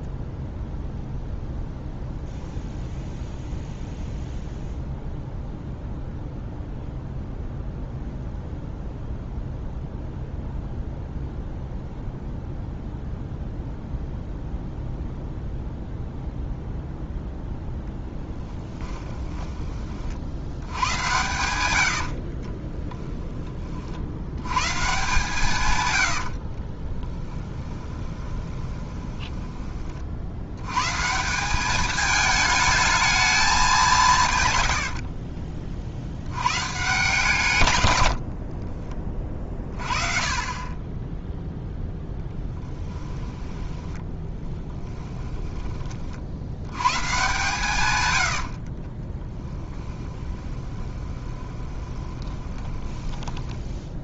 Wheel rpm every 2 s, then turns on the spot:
0, 0, 0, 0, 0, 0, 0, 0, 0, 10, 100, 20, 130, 30, 20, 120, 210, 110, 130, 30, 20, 10, 10, 110, 40, 20, 10.
18-20 22-24 26-30 34-36 42-46 48-54